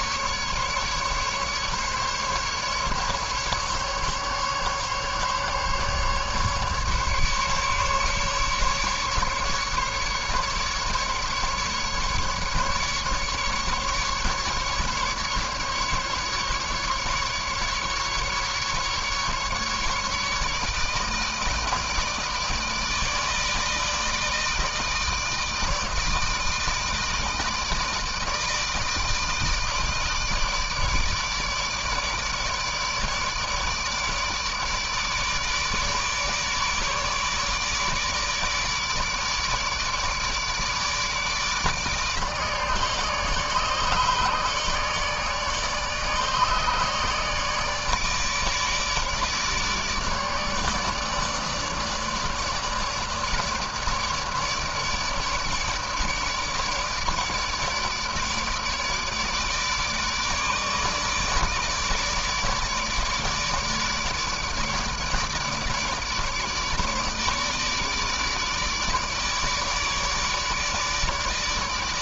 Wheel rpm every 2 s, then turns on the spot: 150, 150, 150, 140, 150, 140, 150, 150, 140, 150, 150, 160, 160, 160, 160, 160, 150, 150, 150, 150, 150, 150, 150, 150, 150, 150, 150, 150, 150, 150, 150, 150, 150, 150, 150, 150.
none